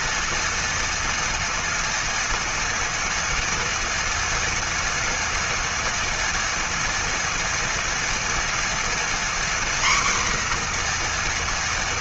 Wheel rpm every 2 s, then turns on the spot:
230, 230, 230, 230, 240, 240.
none